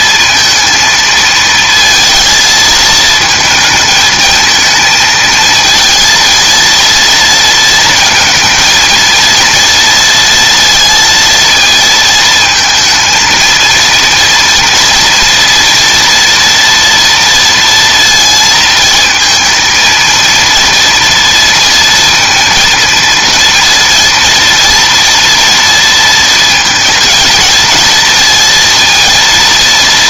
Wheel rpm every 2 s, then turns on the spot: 230, 230, 220, 230, 220, 230, 230, 230, 230, 220, 230, 230, 230, 230, 230.
none